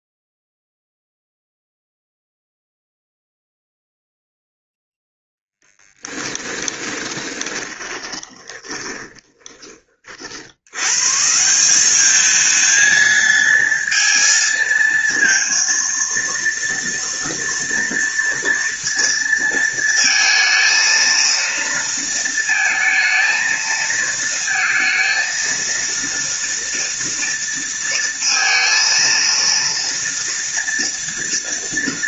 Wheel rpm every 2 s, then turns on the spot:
0, 0, 0, 20, 30, 120, 220, 230, 230, 230, 230, 230, 230, 230, 230, 230.
6-10